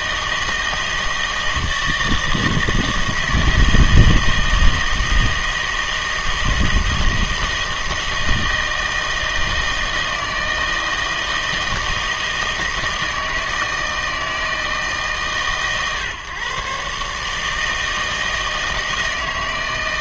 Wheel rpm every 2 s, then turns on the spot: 160, 160, 160, 160, 160, 160, 160, 160, 130, 160.
none